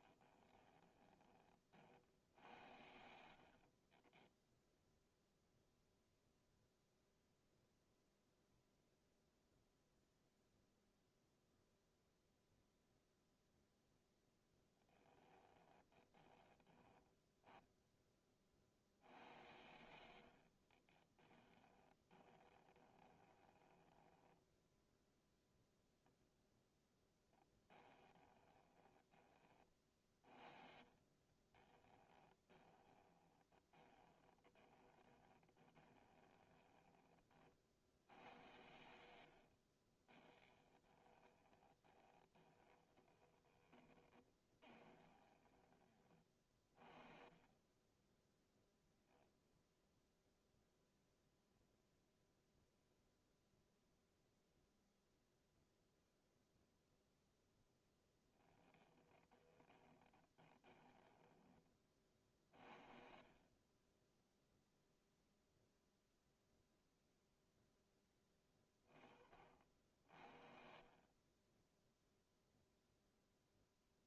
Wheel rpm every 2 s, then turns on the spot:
20, 60, 0, 0, 0, 0, 0, 10, 20, 50, 50, 20, 10, 0, 20, 40, 20, 20, 10, 80, 20, 30, 20, 30, 0, 0, 0, 0, 0, 20, 10, 40, 0, 0, 20, 50, 0.
0-2 14-16 20-24 28-38 40-46 58-62